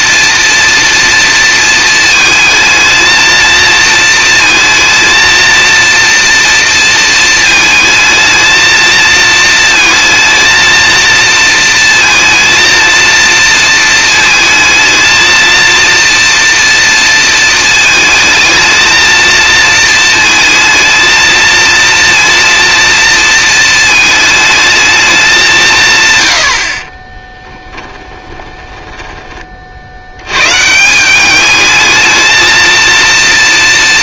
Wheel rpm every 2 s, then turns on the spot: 230, 230, 230, 220, 230, 220, 230, 230, 220, 230, 230, 230, 190, 10, 50, 210, 230.
26-28